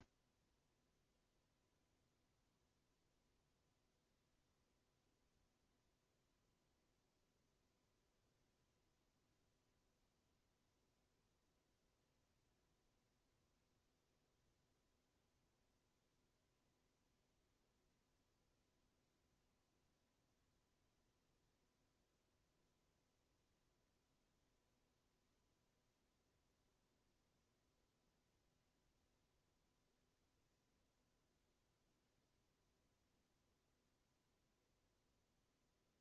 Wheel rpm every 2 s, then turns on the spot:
0, 0, 0, 0, 0, 0, 0, 0, 0, 0, 0, 0, 0, 0, 0, 0, 0, 0.
none